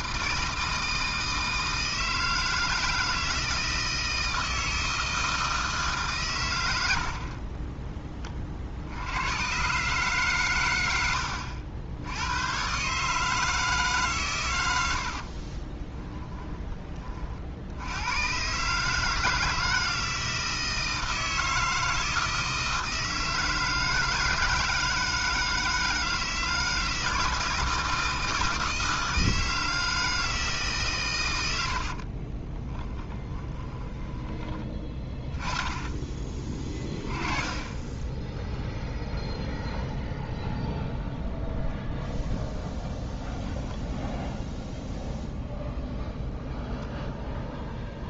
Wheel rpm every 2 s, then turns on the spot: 160, 160, 160, 90, 60, 110, 120, 100, 20, 140, 160, 160, 160, 160, 160, 150, 30, 20, 20, 0, 0, 0, 0, 0.
14-16 32-34